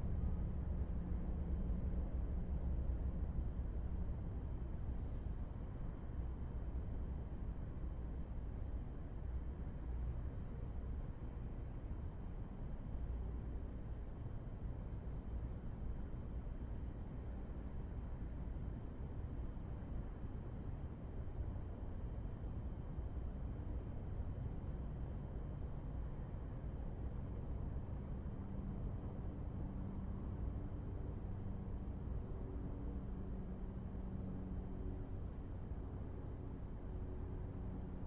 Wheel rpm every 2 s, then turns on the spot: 0, 0, 0, 0, 0, 0, 0, 0, 0, 0, 0, 0, 0, 0, 0, 0, 0, 0, 0.
none